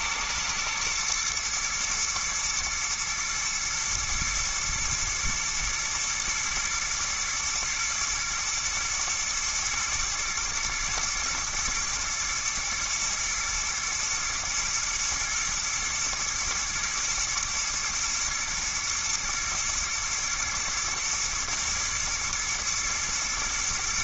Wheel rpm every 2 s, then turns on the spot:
120, 120, 110, 110, 110, 120, 120, 120, 120, 120, 120, 120.
none